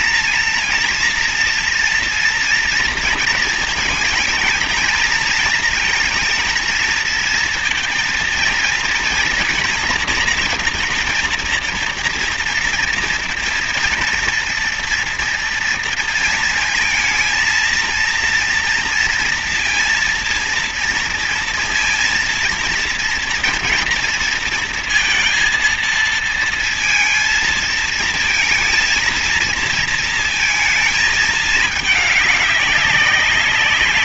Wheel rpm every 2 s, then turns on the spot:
230, 230, 230, 230, 230, 230, 230, 230, 230, 230, 230, 230, 230, 230, 230, 230, 200.
none